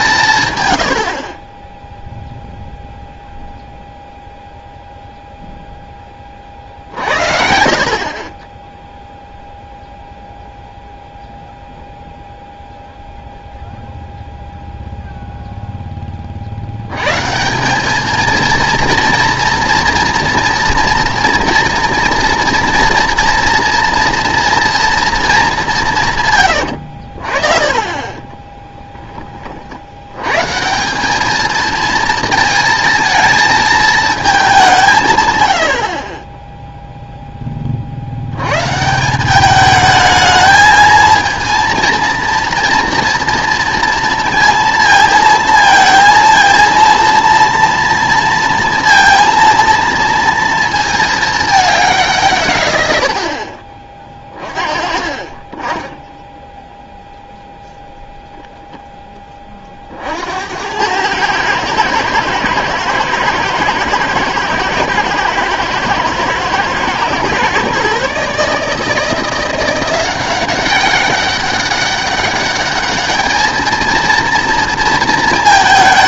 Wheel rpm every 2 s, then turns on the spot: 100, 0, 0, 60, 10, 0, 0, 0, 90, 230, 240, 230, 230, 80, 10, 170, 220, 170, 0, 150, 220, 240, 230, 230, 230, 230, 110, 30, 0, 0, 90, 110, 110, 110, 160, 200, 210, 230.
none